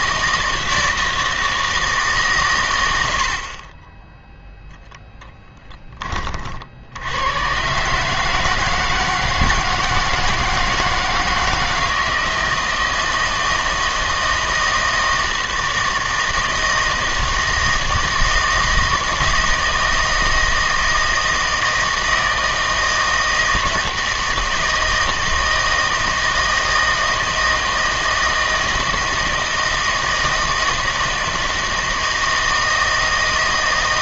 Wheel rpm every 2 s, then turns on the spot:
160, 120, 0, 60, 160, 160, 160, 160, 160, 160, 160, 160, 160, 160, 160, 160, 160.
none